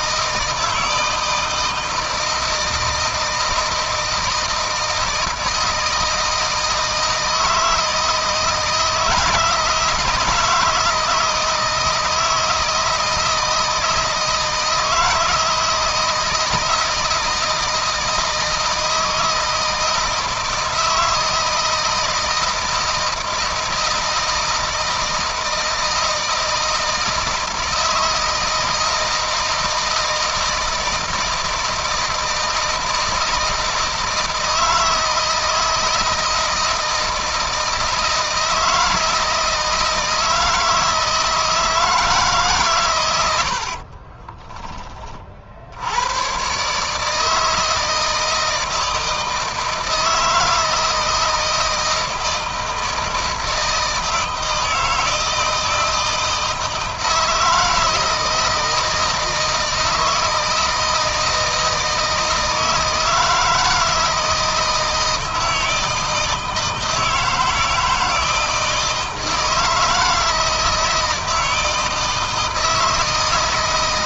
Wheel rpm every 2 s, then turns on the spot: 160, 160, 160, 160, 160, 160, 160, 160, 160, 160, 160, 160, 160, 160, 160, 160, 160, 160, 160, 170, 160, 130, 30, 140, 160, 160, 160, 160, 160, 160, 160, 160, 160, 160, 160, 160, 160.
none